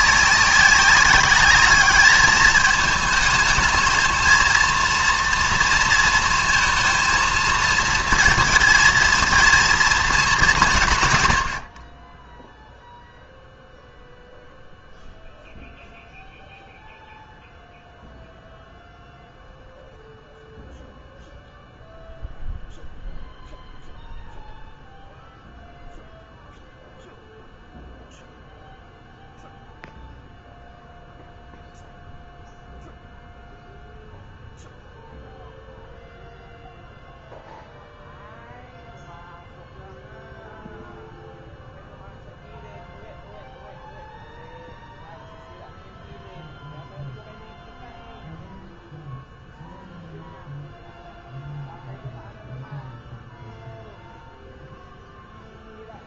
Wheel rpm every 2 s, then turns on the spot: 190, 210, 230, 230, 230, 180, 0, 0, 0, 0, 0, 0, 0, 0, 0, 0, 0, 0, 0, 0, 0, 0, 0, 0, 0, 0, 0, 0.
none